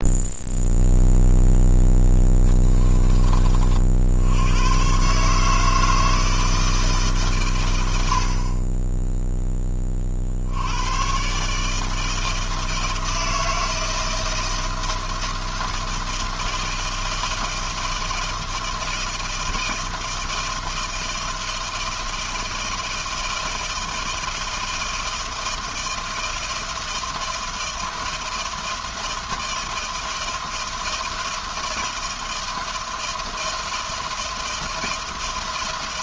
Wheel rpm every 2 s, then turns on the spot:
0, 20, 120, 160, 10, 100, 160, 160, 160, 160, 160, 160, 160, 160, 160, 160, 160, 160.
2-4